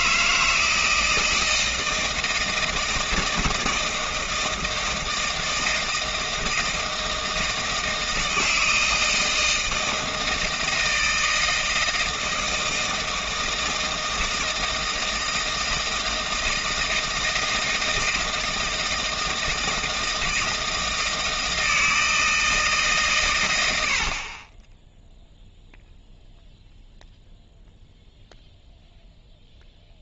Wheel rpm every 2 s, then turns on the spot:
160, 160, 160, 160, 160, 160, 160, 160, 160, 160, 160, 150, 10, 0, 0.
none